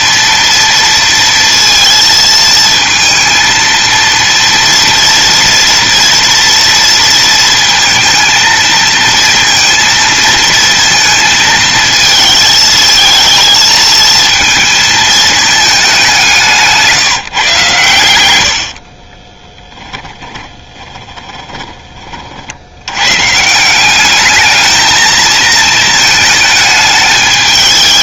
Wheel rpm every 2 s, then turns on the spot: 230, 230, 240, 230, 220, 230, 230, 220, 160, 40, 20, 110, 220, 210.
18-22